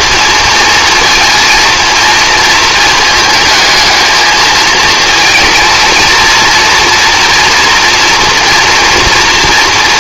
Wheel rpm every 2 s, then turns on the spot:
230, 230, 220, 230, 240.
none